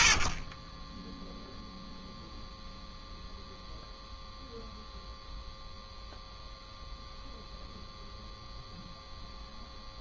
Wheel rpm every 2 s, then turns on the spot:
10, 0, 0, 0, 0.
none